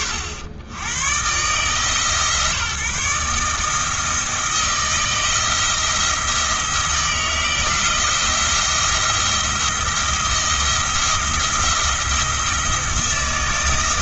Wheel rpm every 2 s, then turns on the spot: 100, 150, 160, 160, 170, 170, 170.
none